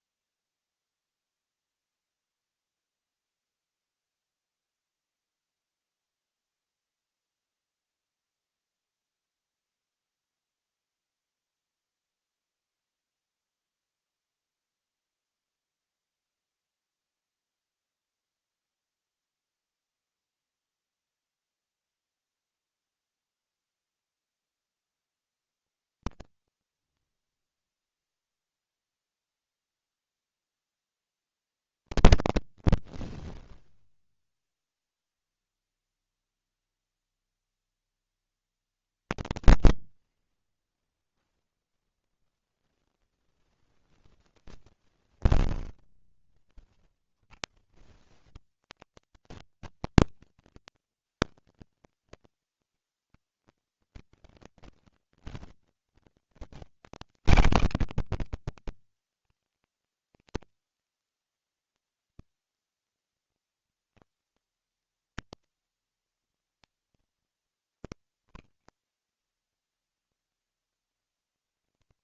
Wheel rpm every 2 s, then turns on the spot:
0, 0, 0, 0, 0, 0, 0, 0, 0, 0, 0, 0, 0, 0, 0, 0, 0, 0, 0, 0, 0, 0, 10, 30, 110, 220, 200, 200, 200, 140, 150, 160, 150, 150, 140, 140.
44-48